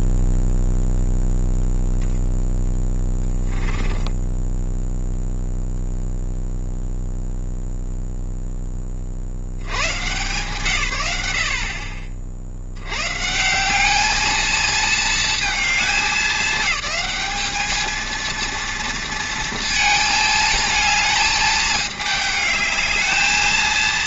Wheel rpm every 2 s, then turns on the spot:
0, 0, 0, 0, 10, 140, 70, 220, 200, 230, 220, 210.
none